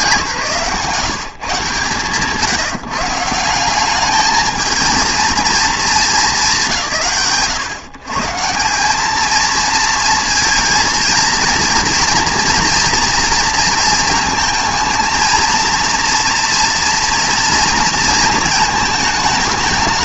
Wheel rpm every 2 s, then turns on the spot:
160, 150, 220, 120, 180, 230, 230, 220, 230, 230.
none